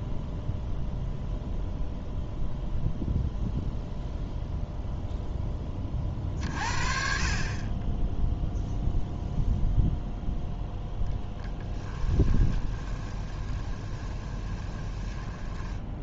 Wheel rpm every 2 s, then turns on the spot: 0, 0, 0, 40, 0, 10, 20, 20.
12-16